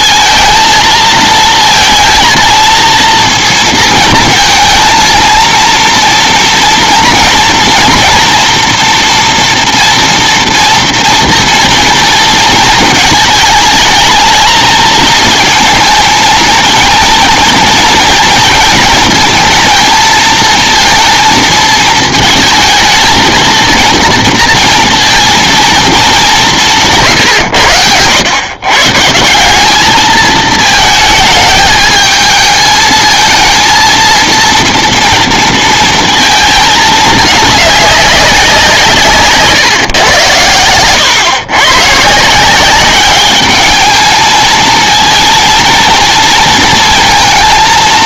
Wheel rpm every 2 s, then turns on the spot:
220, 230, 230, 230, 230, 230, 220, 220, 230, 230, 230, 220, 230, 170, 130, 220, 220, 230, 220, 180, 110, 190, 220, 230.
none